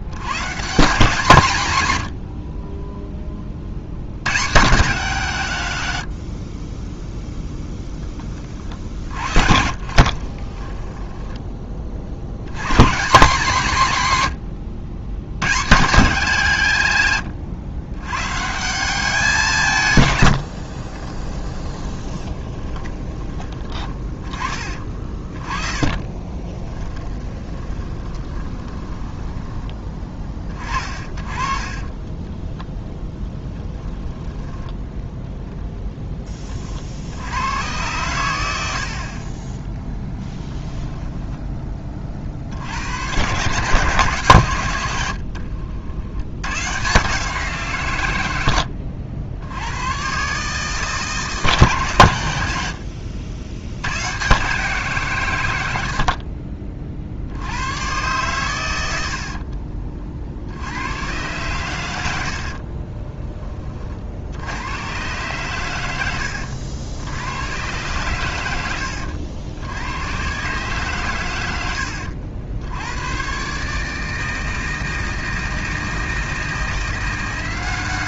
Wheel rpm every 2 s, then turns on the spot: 160, 20, 160, 10, 40, 10, 150, 100, 130, 180, 40, 20, 30, 20, 20, 30, 0, 10, 60, 80, 10, 80, 100, 150, 80, 160, 70, 140, 50, 80, 100, 30, 110, 90, 70, 130, 100, 160, 170.
2-4 8-12 20-32 38-40 44-46 62-64